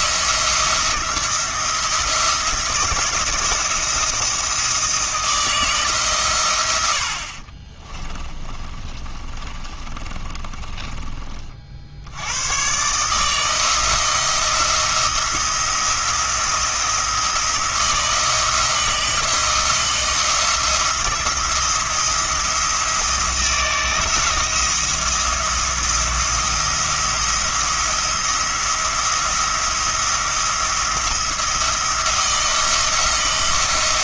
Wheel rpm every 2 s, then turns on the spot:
170, 170, 160, 80, 20, 30, 130, 170, 170, 170, 170, 170, 170, 170, 170, 170, 170.
8-12